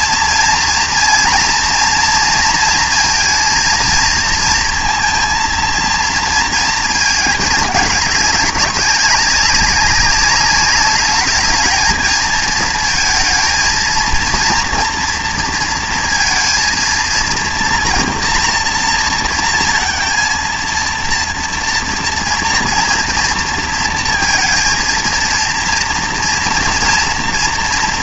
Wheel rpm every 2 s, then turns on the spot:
230, 230, 230, 220, 200, 210, 230, 230, 230, 230, 230, 230, 230, 230.
none